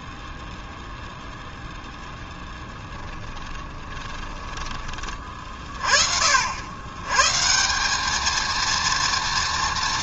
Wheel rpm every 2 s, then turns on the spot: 0, 20, 20, 100, 230.
2-4